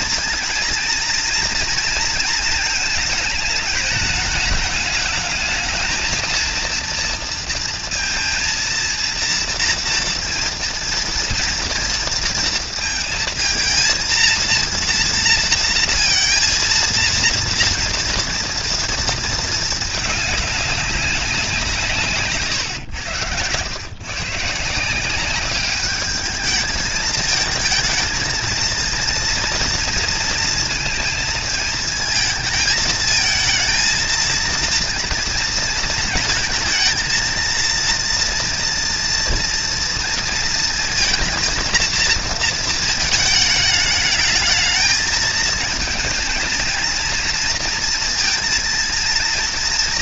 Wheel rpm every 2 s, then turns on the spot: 230, 230, 220, 230, 230, 230, 230, 230, 230, 230, 210, 140, 140, 210, 230, 230, 220, 230, 230, 230, 230, 230, 210, 230, 230.
22-24